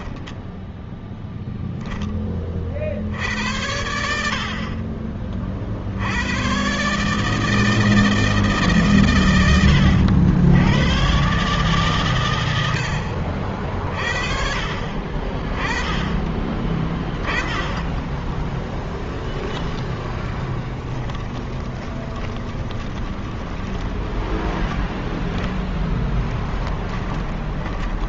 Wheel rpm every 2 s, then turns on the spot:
0, 30, 50, 110, 150, 90, 100, 50, 20, 10, 10, 20, 10, 10.
20-28